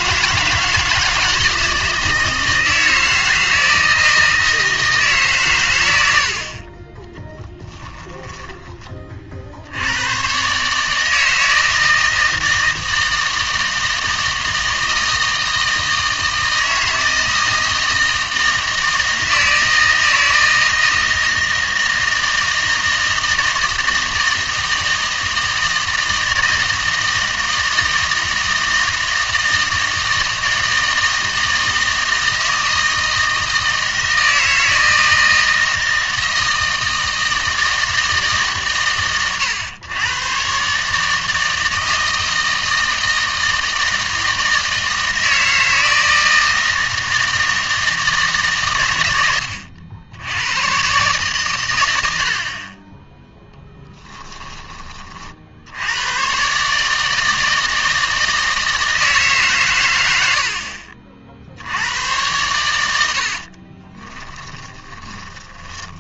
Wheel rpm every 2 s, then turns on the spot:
160, 160, 160, 30, 20, 150, 160, 160, 160, 160, 160, 160, 160, 160, 160, 160, 160, 160, 160, 140, 140, 160, 160, 160, 120, 120, 20, 30, 150, 160, 40, 100, 10.
64-66